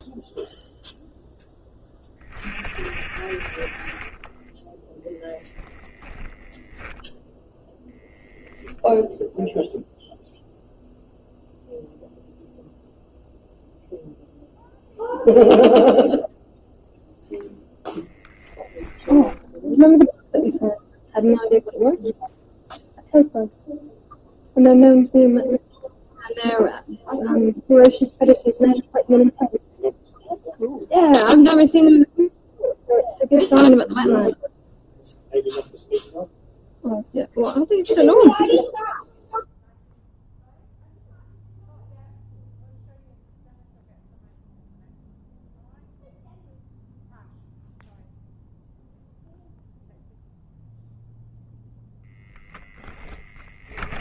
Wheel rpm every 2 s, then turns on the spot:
0, 40, 0, 0, 0, 0, 0, 0, 0, 0, 0, 0, 0, 0, 0, 0, 0, 0, 0, 0, 0, 0, 0, 0, 0, 0, 10.
52-54